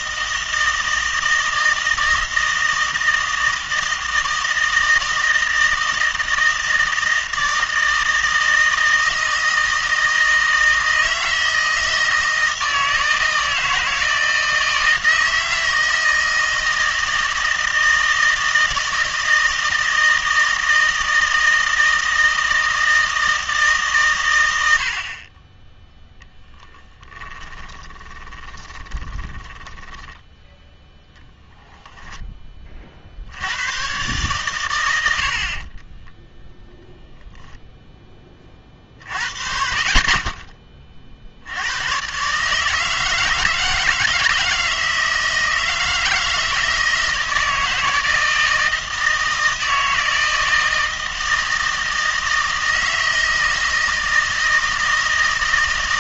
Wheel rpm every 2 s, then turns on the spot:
160, 160, 160, 160, 160, 160, 160, 160, 160, 160, 160, 160, 80, 10, 20, 0, 40, 90, 0, 40, 30, 160, 160, 160, 160, 160, 160, 160.
26-30